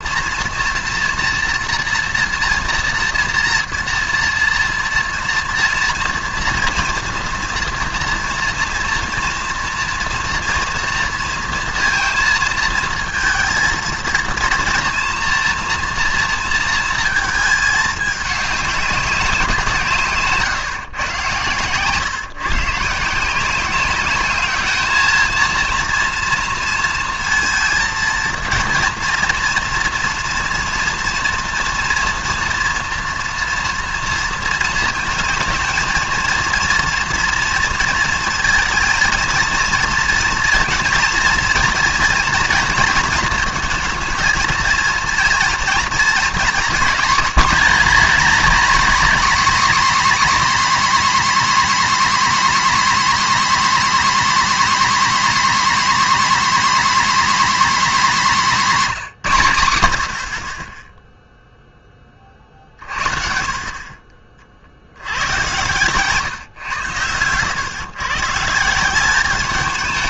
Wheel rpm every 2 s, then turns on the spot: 240, 230, 230, 230, 230, 240, 230, 230, 230, 210, 140, 150, 210, 230, 230, 230, 240, 230, 230, 230, 230, 230, 230, 250, 300, 300, 300, 300, 300, 240, 40, 40, 50, 130, 160.
none